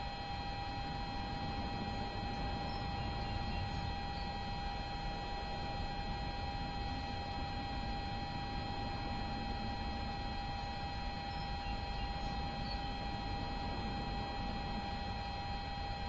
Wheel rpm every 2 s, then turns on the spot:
0, 0, 0, 0, 0, 0, 0, 0.
none